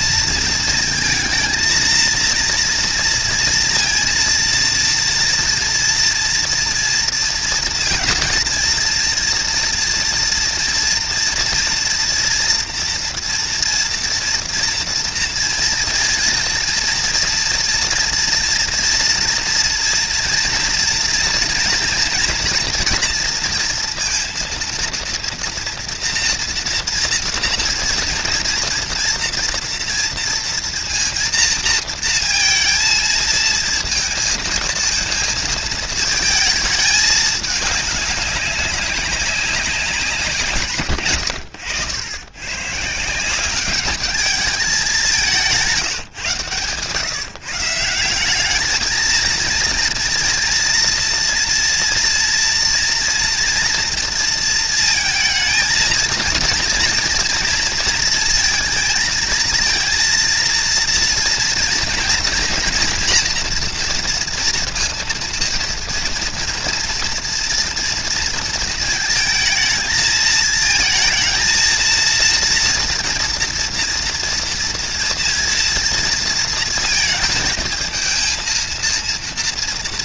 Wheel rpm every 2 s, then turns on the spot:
230, 230, 230, 230, 230, 230, 230, 230, 230, 230, 230, 240, 230, 230, 230, 230, 220, 220, 220, 200, 140, 130, 200, 130, 220, 230, 230, 230, 230, 230, 230, 240, 240, 230, 220, 220, 230, 230, 230, 230.
none